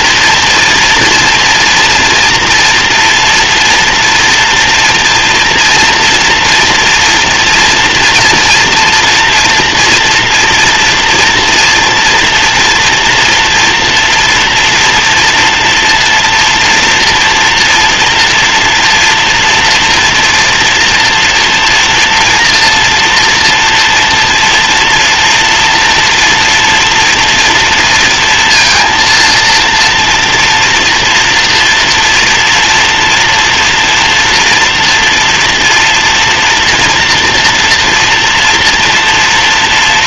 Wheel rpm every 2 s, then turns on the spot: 230, 230, 230, 240, 230, 230, 230, 230, 230, 240, 230, 230, 240, 230, 230, 230, 230, 230, 240, 230.
none